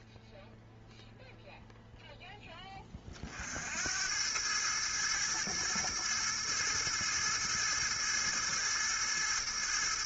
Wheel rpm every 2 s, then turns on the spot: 0, 10, 100, 110, 110.
none